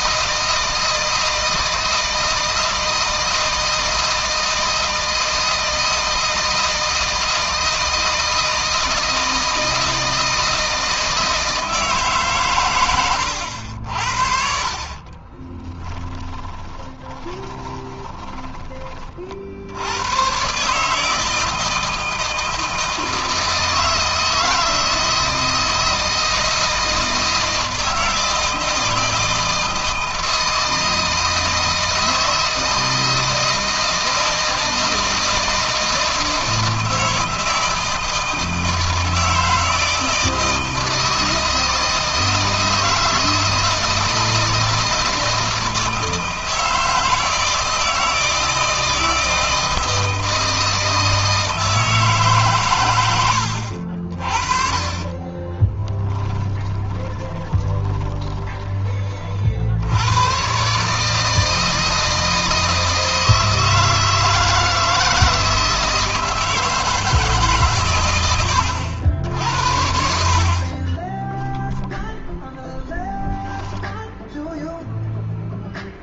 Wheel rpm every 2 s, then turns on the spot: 160, 160, 160, 160, 160, 160, 120, 30, 20, 30, 140, 160, 160, 160, 160, 160, 160, 160, 160, 160, 160, 160, 170, 160, 160, 160, 120, 30, 20, 30, 140, 160, 160, 160, 80, 30, 0, 0.
12-18 54-58 70-72